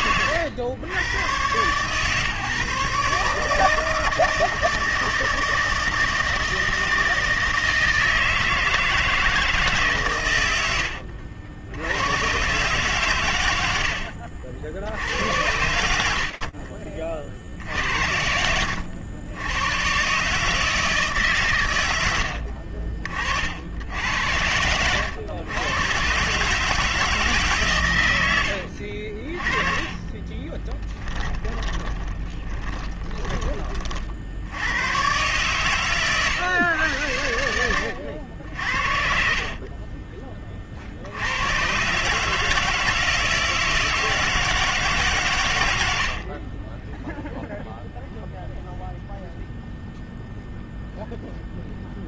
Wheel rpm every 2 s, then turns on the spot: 120, 150, 160, 160, 160, 70, 130, 70, 60, 80, 160, 40, 100, 150, 50, 10, 20, 120, 100, 50, 80, 160, 140, 0, 0, 0.
10-12 28-32